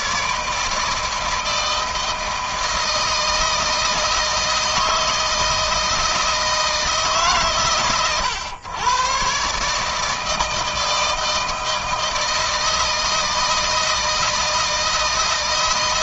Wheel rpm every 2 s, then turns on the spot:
160, 160, 160, 150, 120, 160, 160, 160.
none